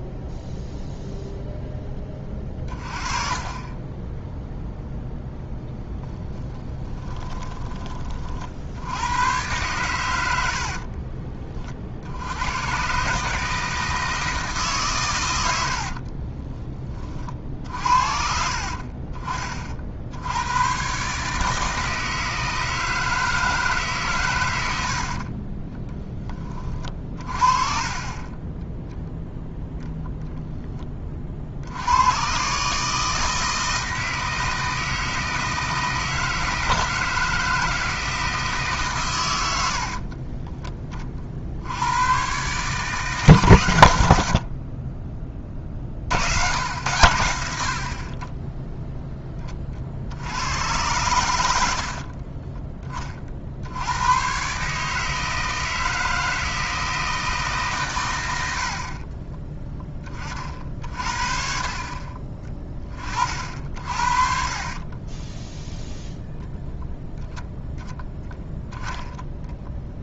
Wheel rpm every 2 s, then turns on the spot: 0, 30, 0, 10, 50, 70, 110, 150, 20, 50, 100, 160, 100, 30, 10, 10, 130, 160, 160, 150, 20, 140, 50, 100, 10, 90, 20, 130, 160, 80, 40, 30, 40, 0, 0.
6-8 10-12 16-18 26-28 58-60 64-66